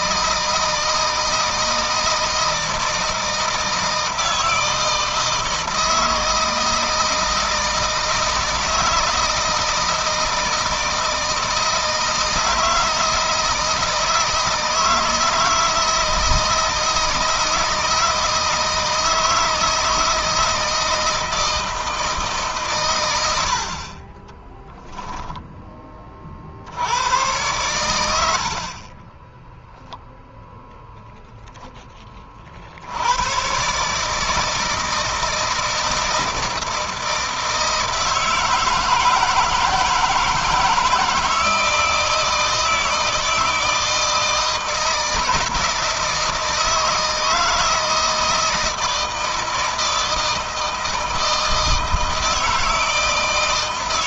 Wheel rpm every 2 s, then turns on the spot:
160, 160, 160, 160, 160, 160, 160, 160, 160, 160, 160, 130, 10, 90, 30, 0, 70, 160, 160, 160, 160, 160, 160, 160, 160, 160, 160.
24-26